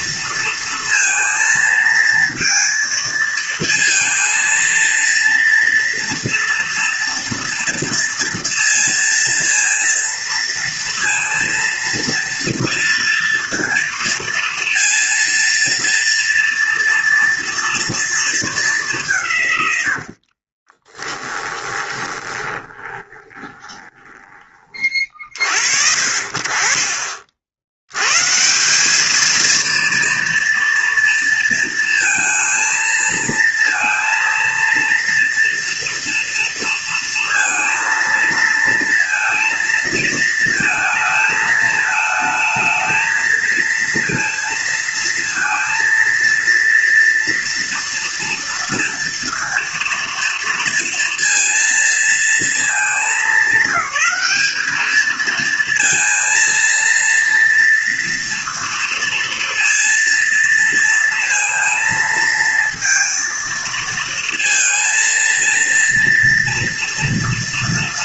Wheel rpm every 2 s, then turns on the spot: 230, 220, 230, 230, 230, 230, 230, 230, 240, 190, 20, 20, 40, 50, 200, 230, 230, 230, 230, 230, 220, 220, 230, 230, 230, 230, 220, 220, 230, 230, 230, 230, 230, 230.
20-24